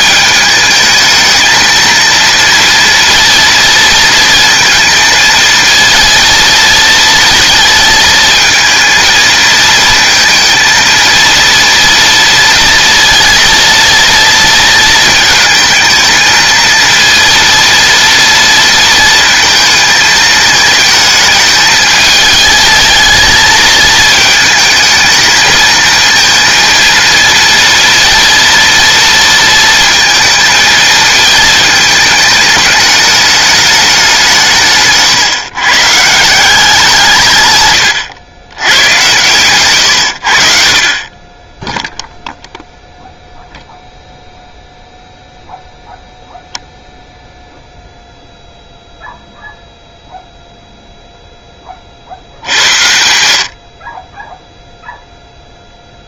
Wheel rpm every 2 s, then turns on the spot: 220, 230, 230, 230, 220, 230, 230, 230, 230, 230, 220, 220, 220, 230, 230, 230, 210, 160, 170, 90, 70, 0, 0, 0, 0, 0, 70, 0.
none